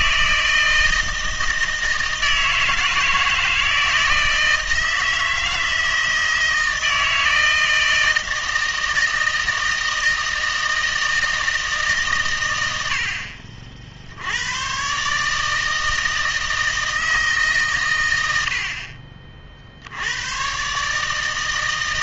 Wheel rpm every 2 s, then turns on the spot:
160, 160, 160, 160, 160, 160, 90, 120, 160, 50, 140.
none